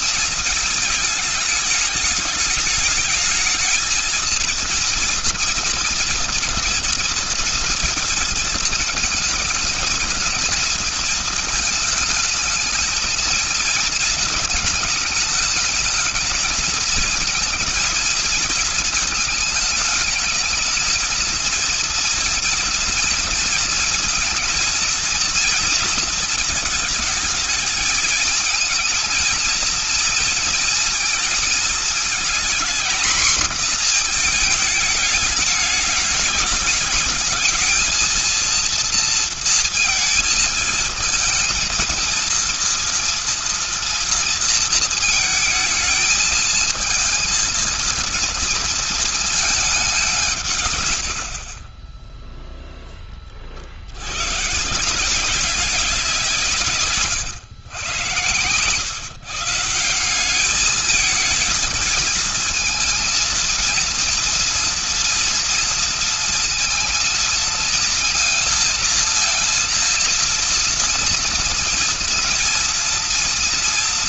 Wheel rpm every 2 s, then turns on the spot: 220, 220, 230, 230, 220, 230, 220, 220, 230, 220, 220, 230, 230, 220, 220, 230, 240, 220, 210, 230, 220, 230, 220, 220, 230, 120, 20, 180, 140, 140, 220, 230, 230, 230, 230, 230, 230.
none